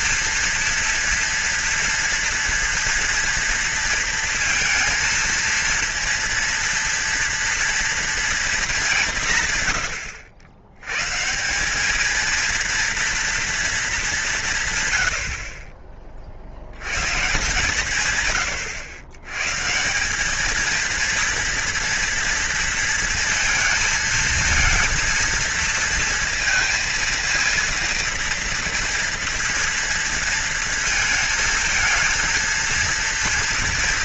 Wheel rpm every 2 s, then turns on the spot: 230, 230, 230, 230, 220, 90, 230, 130, 100, 100, 220, 230, 230, 230, 230, 220, 230.
none